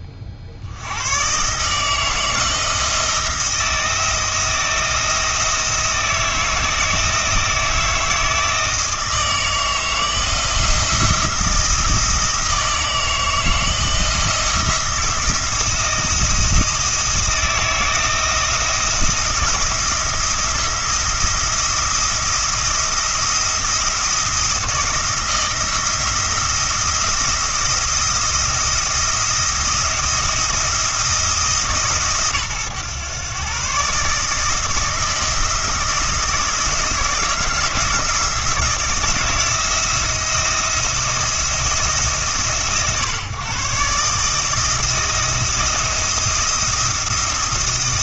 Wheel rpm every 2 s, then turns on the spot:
80, 160, 160, 160, 160, 170, 160, 170, 170, 170, 170, 170, 170, 170, 170, 170, 120, 160, 170, 160, 170, 130, 160, 170.
none